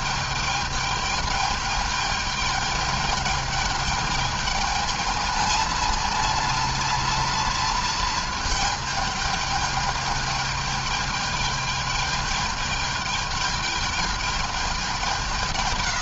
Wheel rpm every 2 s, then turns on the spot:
210, 210, 220, 230, 210, 210, 210, 190.
none